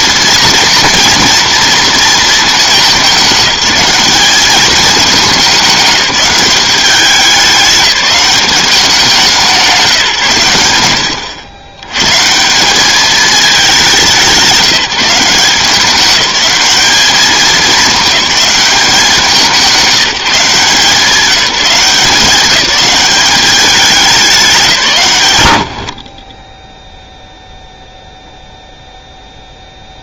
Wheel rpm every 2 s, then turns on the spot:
230, 200, 200, 190, 190, 100, 200, 170, 210, 200, 160, 200, 170, 10, 0.
none